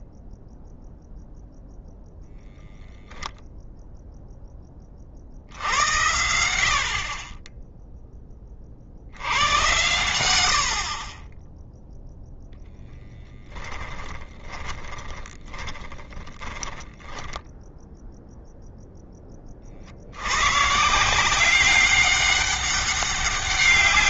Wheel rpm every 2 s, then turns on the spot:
0, 0, 10, 80, 20, 80, 0, 10, 10, 0, 120, 190.
14-18